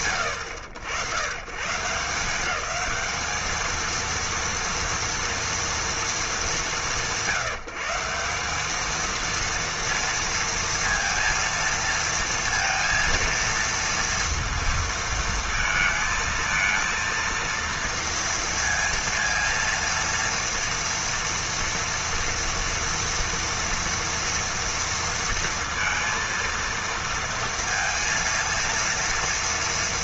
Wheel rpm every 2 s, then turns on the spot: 70, 210, 230, 160, 220, 230, 230, 230, 230, 230, 230, 230, 230, 230, 230.
none